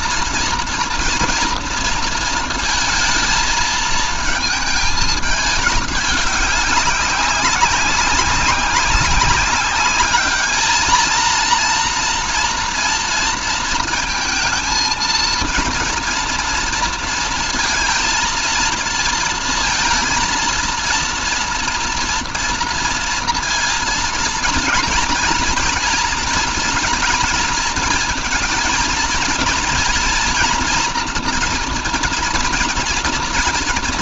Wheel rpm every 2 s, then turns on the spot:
230, 220, 220, 200, 190, 220, 230, 230, 230, 230, 230, 230, 230, 230, 230, 230, 240.
none